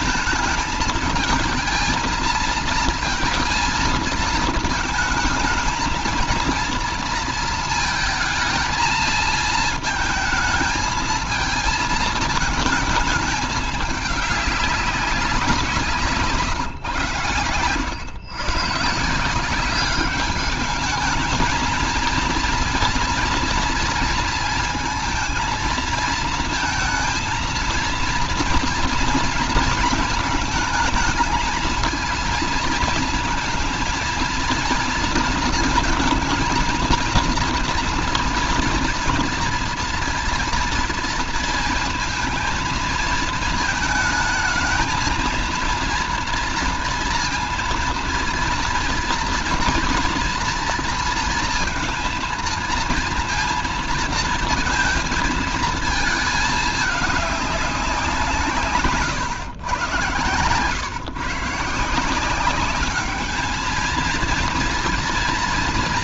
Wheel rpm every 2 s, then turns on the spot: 220, 230, 220, 230, 230, 220, 220, 200, 130, 150, 210, 230, 230, 220, 230, 220, 230, 230, 230, 230, 230, 220, 220, 230, 240, 230, 230, 230, 220, 140, 120, 200, 230.
58-60